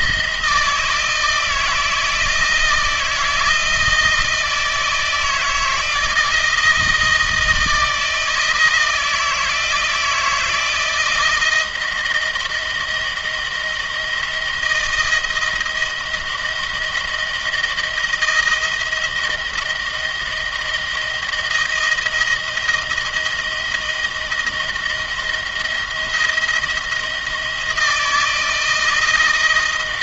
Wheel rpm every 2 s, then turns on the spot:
160, 160, 160, 160, 160, 160, 160, 160, 160, 160, 170, 170, 160, 170, 160.
none